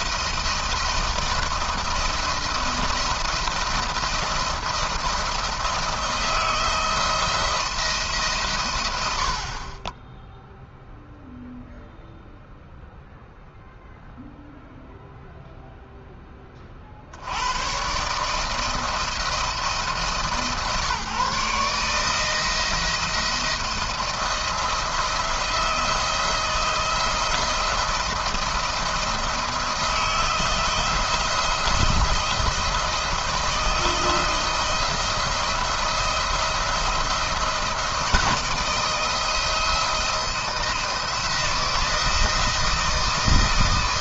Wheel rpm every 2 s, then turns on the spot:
170, 170, 170, 170, 120, 0, 0, 0, 20, 160, 140, 160, 170, 170, 170, 160, 160, 170, 170, 170, 170, 160.
none